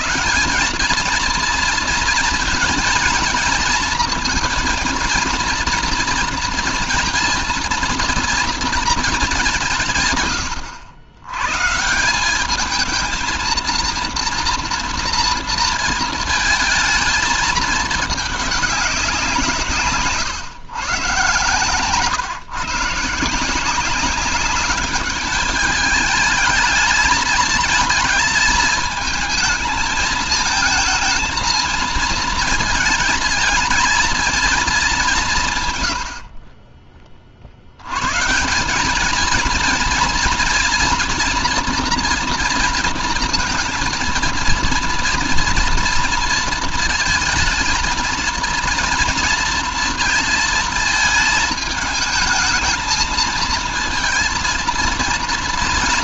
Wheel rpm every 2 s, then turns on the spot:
220, 230, 240, 230, 210, 90, 220, 230, 220, 190, 140, 160, 200, 220, 220, 220, 220, 190, 30, 200, 230, 230, 230, 230, 220, 220, 230, 230.
none